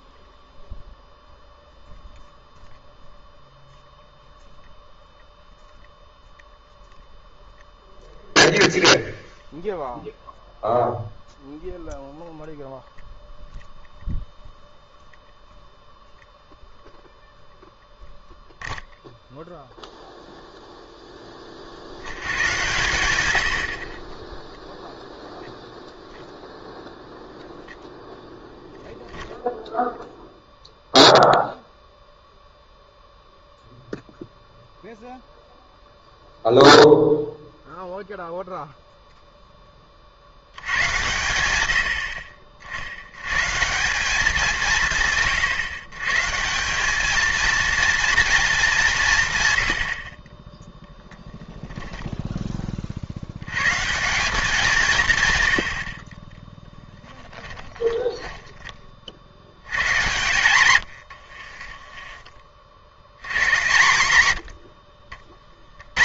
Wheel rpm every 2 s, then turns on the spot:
0, 0, 0, 0, 0, 0, 0, 0, 0, 0, 0, 110, 0, 0, 0, 0, 0, 0, 0, 0, 90, 70, 170, 190, 200, 10, 40, 180, 10, 30, 100, 70, 70.
56-58